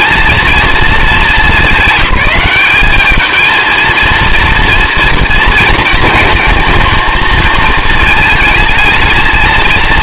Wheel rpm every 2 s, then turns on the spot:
230, 200, 230, 230, 220.
none